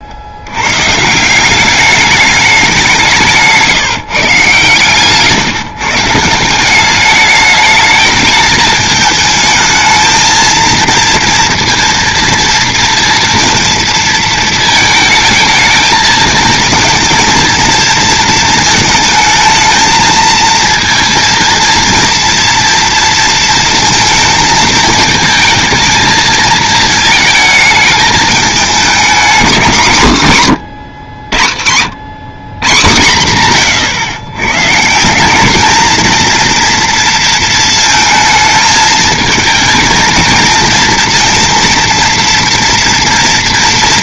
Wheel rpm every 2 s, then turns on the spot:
110, 210, 140, 190, 220, 230, 230, 220, 220, 230, 230, 230, 220, 220, 210, 110, 130, 130, 230, 220, 220, 230.
none